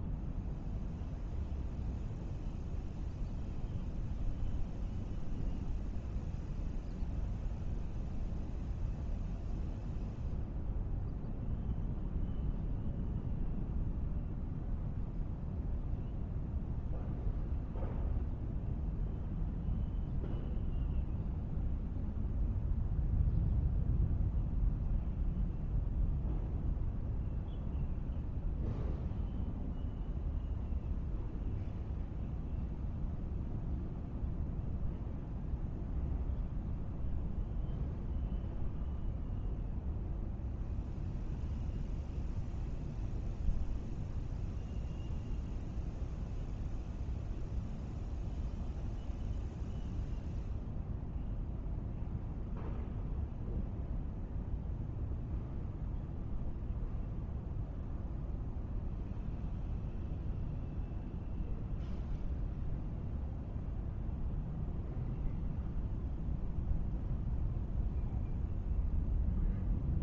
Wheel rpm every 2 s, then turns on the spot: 0, 0, 0, 0, 0, 0, 0, 0, 0, 0, 0, 0, 0, 0, 0, 0, 0, 0, 0, 0, 0, 0, 0, 0, 0, 0, 0, 0, 0, 0, 0, 0, 0, 0, 0.
none